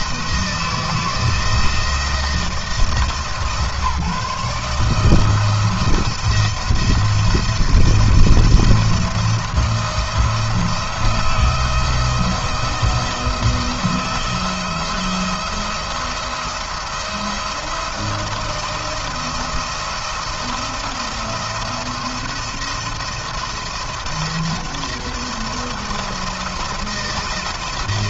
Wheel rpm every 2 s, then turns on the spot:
170, 160, 150, 170, 160, 160, 170, 170, 170, 170, 170, 170, 170, 160.
none